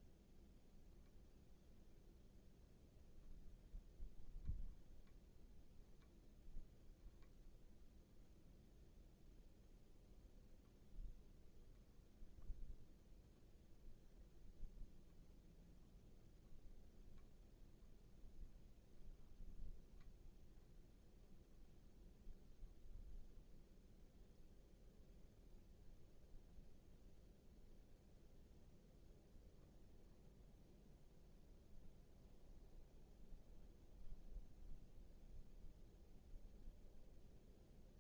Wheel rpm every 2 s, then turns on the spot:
0, 0, 0, 0, 0, 0, 0, 0, 0, 0, 0, 0, 0, 0, 0, 0, 0, 0, 0.
none